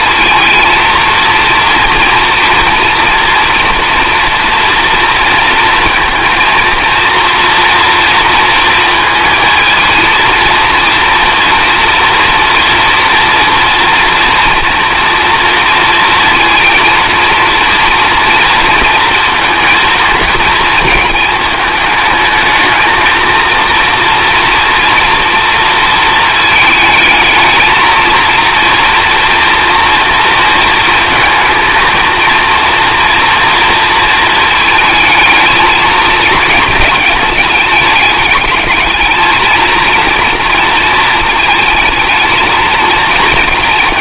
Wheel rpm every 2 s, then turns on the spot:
230, 230, 230, 230, 230, 230, 230, 230, 230, 230, 220, 220, 230, 220, 230, 220, 230, 220, 220, 220, 230, 220.
none